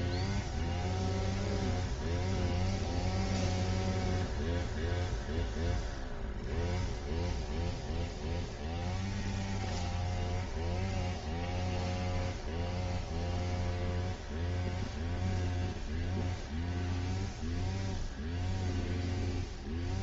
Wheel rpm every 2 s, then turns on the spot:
0, 0, 0, 0, 0, 0, 0, 0, 0, 0.
none